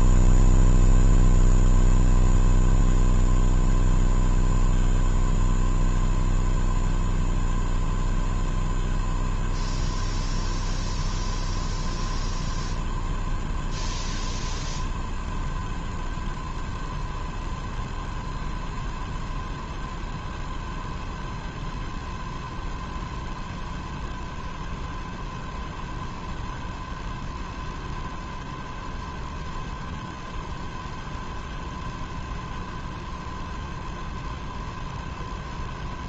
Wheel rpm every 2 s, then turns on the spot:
0, 0, 0, 0, 0, 0, 0, 0, 0, 0, 0, 0, 0, 0, 0, 0, 0, 0.
none